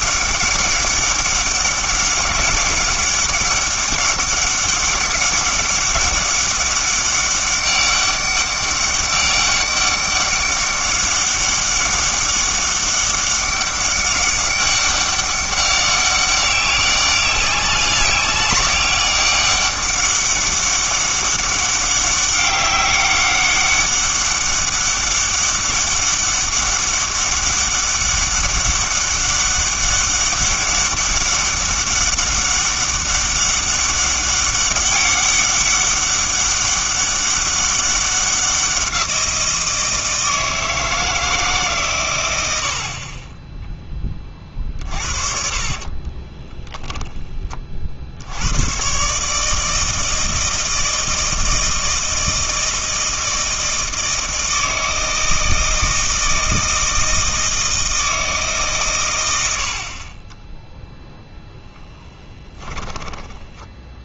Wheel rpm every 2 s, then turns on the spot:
200, 200, 200, 200, 200, 200, 200, 200, 200, 200, 200, 200, 200, 200, 200, 200, 200, 200, 200, 180, 160, 50, 40, 10, 110, 160, 160, 160, 160, 120, 0, 10.
42-46 62-64